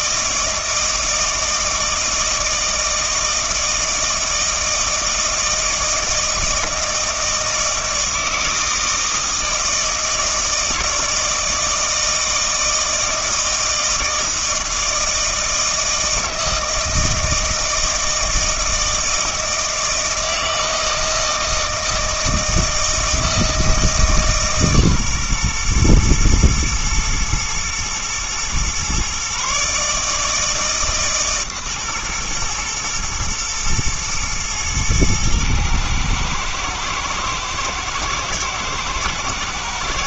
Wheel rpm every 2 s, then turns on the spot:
160, 160, 160, 160, 160, 160, 160, 160, 160, 160, 160, 160, 140, 120, 120, 150, 120, 110, 110, 120.
none